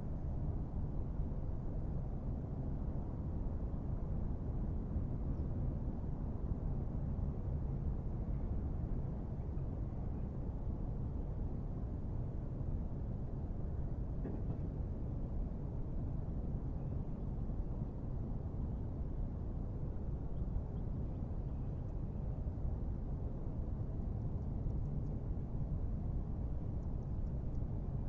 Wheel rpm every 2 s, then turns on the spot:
0, 0, 0, 0, 0, 0, 0, 0, 0, 0, 0, 0, 0, 0.
none